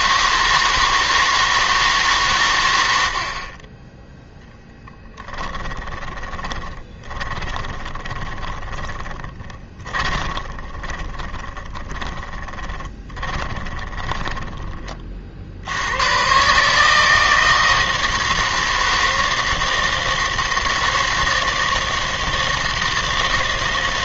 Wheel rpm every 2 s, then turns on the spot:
160, 90, 10, 20, 20, 20, 10, 10, 150, 160, 160, 160.
4-14